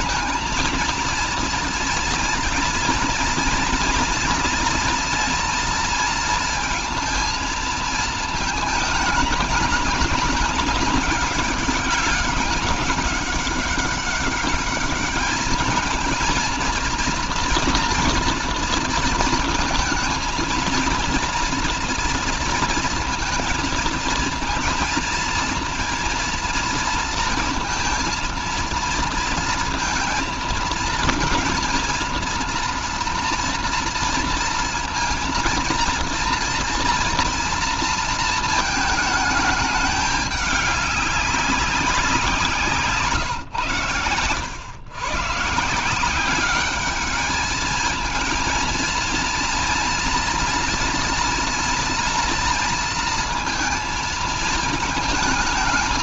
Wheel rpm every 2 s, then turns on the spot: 230, 230, 230, 230, 210, 210, 200, 210, 230, 230, 230, 230, 230, 230, 230, 230, 240, 230, 230, 220, 200, 160, 120, 200, 220, 230, 230, 220.
none